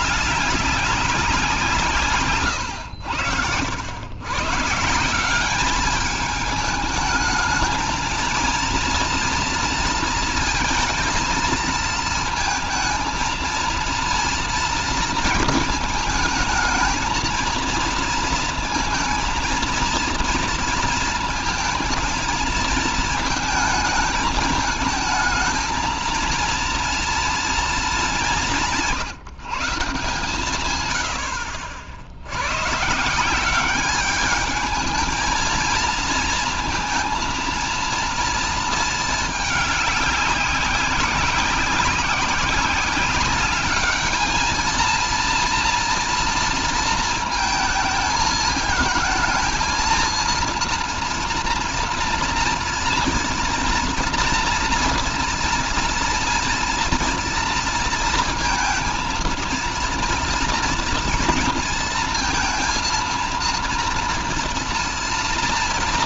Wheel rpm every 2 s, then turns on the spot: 200, 100, 170, 220, 230, 230, 230, 230, 220, 230, 230, 230, 220, 230, 170, 100, 140, 220, 230, 220, 190, 190, 230, 230, 220, 230, 230, 230, 230, 230, 230, 230, 230.
none